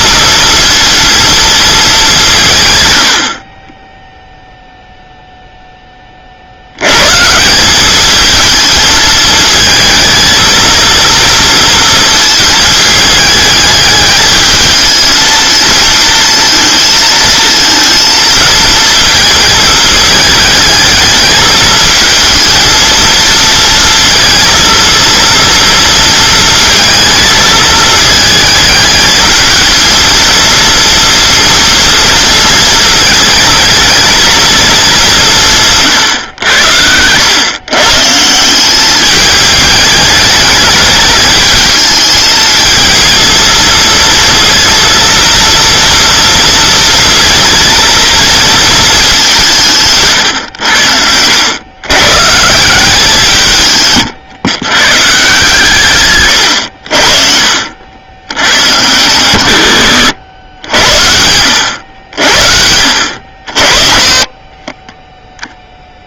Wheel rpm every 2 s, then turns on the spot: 230, 110, 0, 100, 220, 230, 220, 220, 230, 230, 220, 230, 230, 220, 220, 230, 230, 210, 100, 190, 210, 220, 230, 230, 220, 90, 170, 130, 70, 110, 90, 70, 20.
none